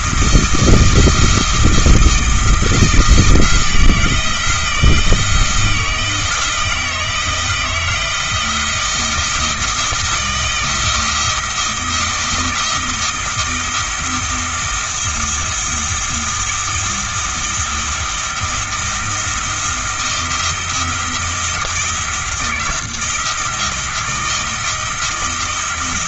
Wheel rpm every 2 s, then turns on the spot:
160, 160, 170, 160, 170, 170, 170, 170, 160, 170, 170, 170, 160.
none